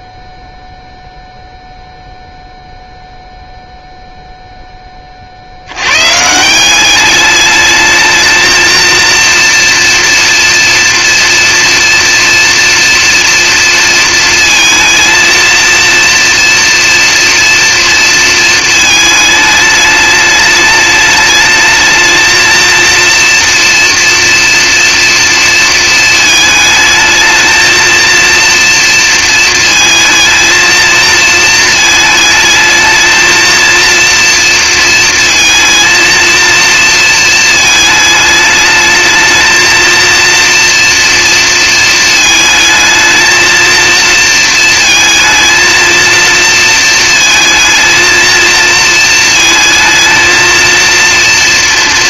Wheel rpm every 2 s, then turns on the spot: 0, 0, 0, 120, 220, 230, 240, 230, 230, 230, 210, 220, 230, 220, 230, 220, 220, 230, 230, 220, 230, 220, 230, 230, 230, 220.
none